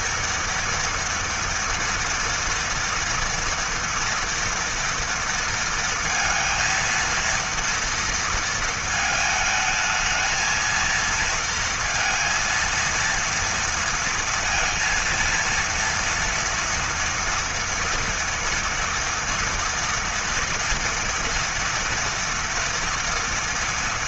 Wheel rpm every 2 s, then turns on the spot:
230, 230, 230, 230, 220, 230, 230, 230, 230, 230, 230, 230.
none